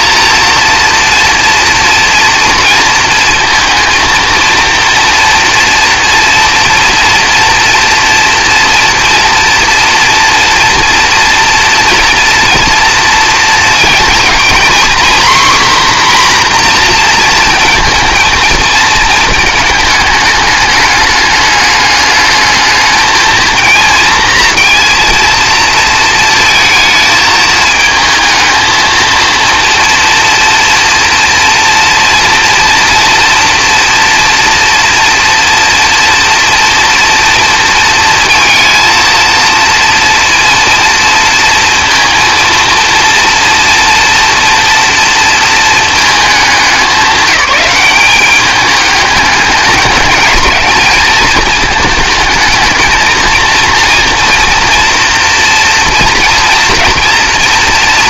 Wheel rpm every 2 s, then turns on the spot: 230, 230, 230, 230, 230, 230, 230, 250, 250, 220, 210, 210, 230, 220, 230, 230, 230, 230, 230, 230, 240, 230, 240, 200, 200, 220, 220, 230, 230.
none